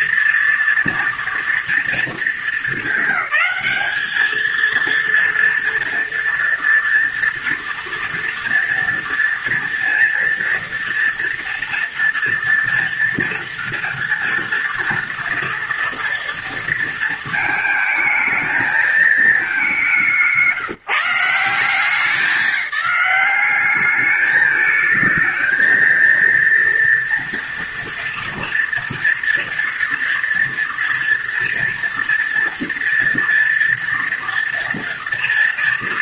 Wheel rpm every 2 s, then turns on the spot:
230, 220, 230, 230, 230, 230, 230, 230, 230, 220, 170, 200, 220, 230, 230, 230, 230, 230.
none